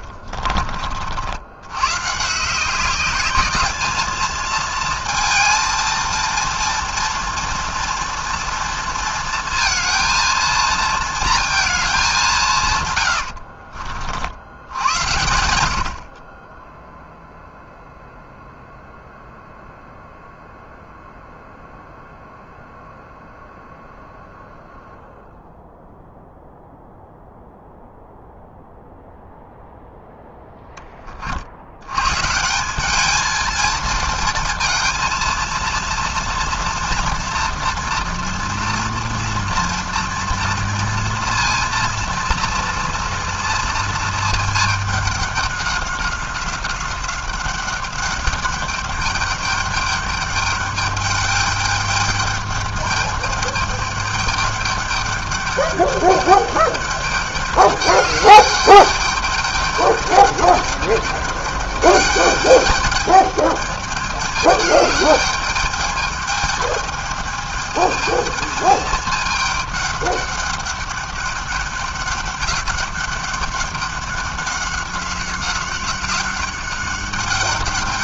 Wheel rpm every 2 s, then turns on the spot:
40, 180, 220, 230, 230, 230, 130, 90, 10, 0, 0, 0, 0, 0, 0, 10, 190, 230, 230, 230, 230, 230, 210, 190, 210, 200, 210, 200, 200, 200, 200, 210, 210, 210, 220, 200, 200, 200, 200.
0-2